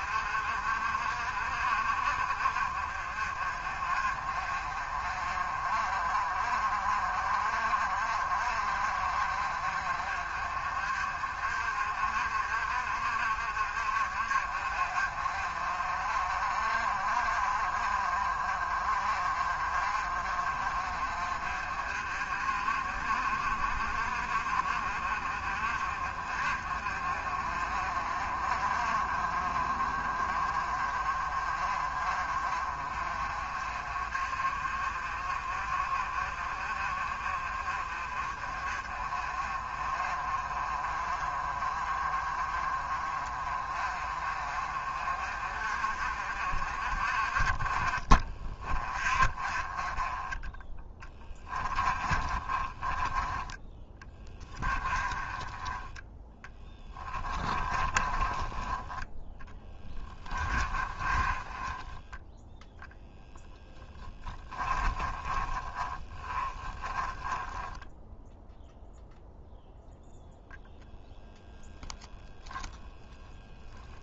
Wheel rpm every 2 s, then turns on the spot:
40, 40, 40, 40, 50, 40, 50, 40, 40, 40, 40, 40, 40, 40, 40, 30, 40, 40, 40, 30, 30, 30, 40, 40, 40, 10, 20, 20, 10, 20, 30, 0, 20, 20, 0, 0, 10.
50-58 60-62 64-68 72-74